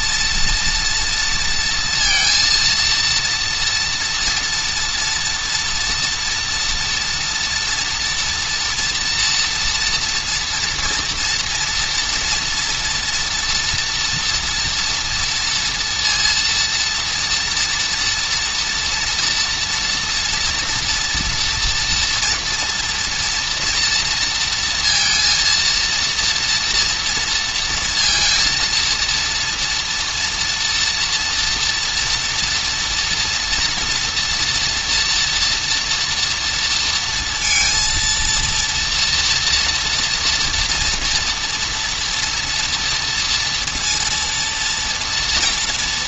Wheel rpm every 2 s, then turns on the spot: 240, 230, 230, 230, 240, 240, 230, 230, 230, 230, 230, 230, 230, 230, 230, 230, 240, 230, 220, 230, 230, 230, 230.
none